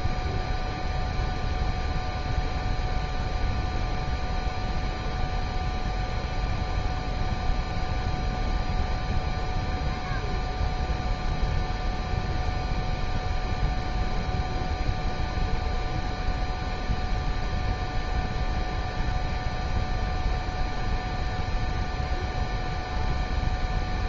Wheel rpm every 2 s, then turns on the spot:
0, 0, 0, 0, 0, 0, 0, 0, 0, 0, 0, 0.
none